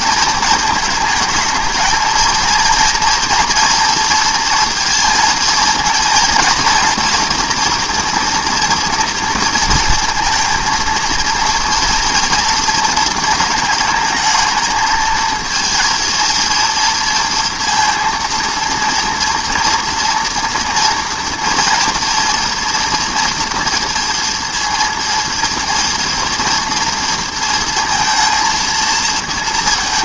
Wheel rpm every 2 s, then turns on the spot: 230, 220, 230, 230, 240, 230, 230, 220, 230, 230, 230, 230, 230, 230, 230.
none